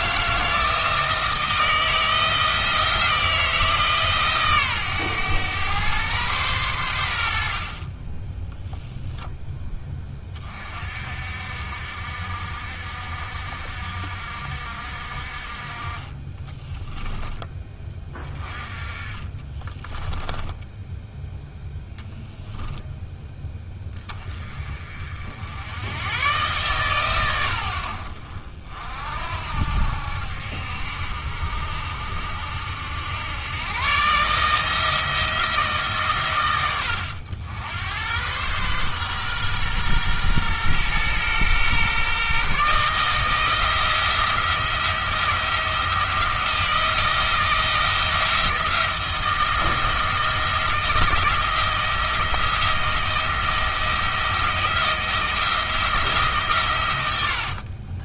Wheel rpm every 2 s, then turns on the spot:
160, 170, 120, 100, 0, 50, 60, 60, 10, 30, 10, 0, 40, 130, 60, 70, 80, 160, 100, 130, 120, 150, 170, 170, 170, 170, 170, 170, 110.
16-18 20-22